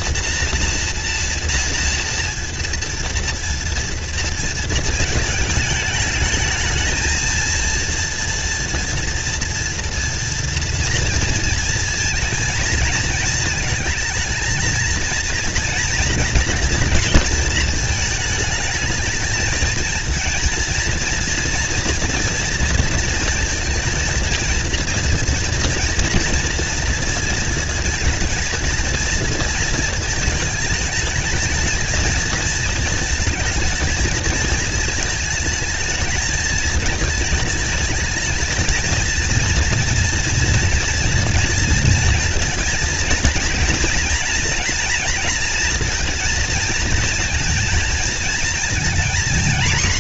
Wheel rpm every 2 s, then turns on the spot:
240, 230, 230, 220, 230, 230, 230, 230, 230, 220, 230, 230, 230, 230, 230, 220, 230, 220, 220, 220, 240, 230, 230, 220, 230.
none